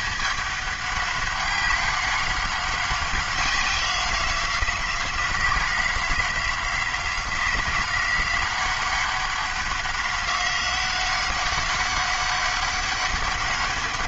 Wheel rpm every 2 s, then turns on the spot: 200, 190, 180, 180, 190, 190, 200.
none